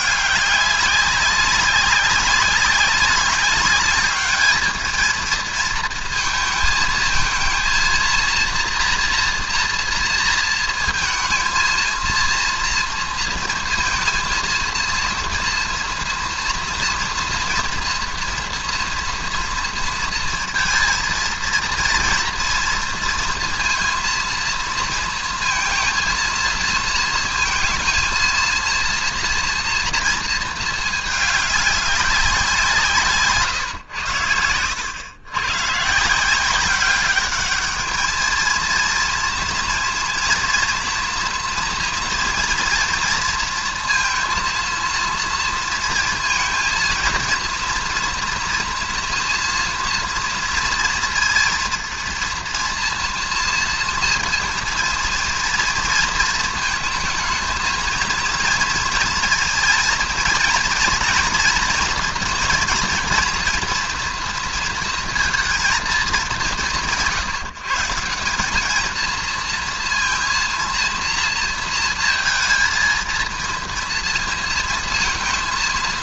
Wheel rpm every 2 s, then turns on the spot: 200, 200, 220, 220, 240, 230, 230, 230, 230, 230, 230, 230, 230, 230, 230, 220, 170, 110, 190, 230, 230, 230, 230, 230, 230, 230, 230, 230, 220, 230, 230, 230, 230, 170, 220, 230, 230, 230.
none